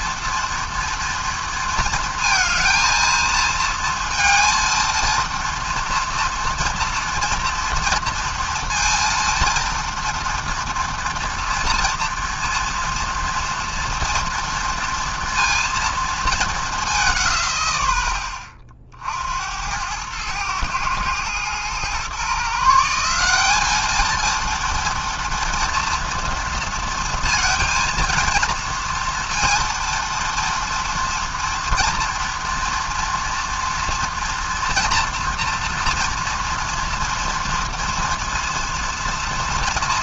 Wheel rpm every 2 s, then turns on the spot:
230, 230, 230, 230, 230, 230, 230, 230, 210, 60, 110, 150, 230, 230, 230, 230, 240, 240, 230, 230.
none